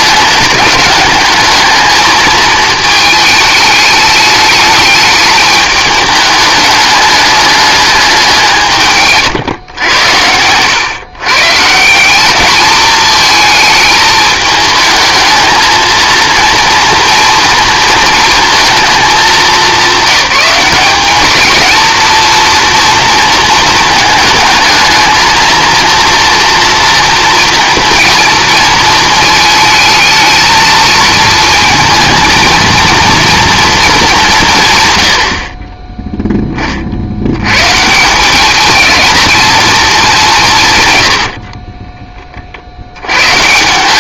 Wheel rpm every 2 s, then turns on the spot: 210, 220, 210, 210, 160, 110, 220, 220, 230, 220, 200, 230, 220, 230, 230, 230, 230, 160, 20, 210, 150, 50.
none